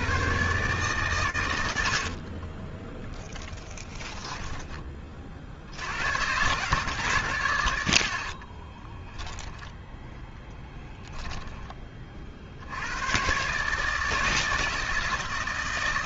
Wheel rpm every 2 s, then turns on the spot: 90, 10, 90, 60, 10, 10, 150, 160.
2-4 8-10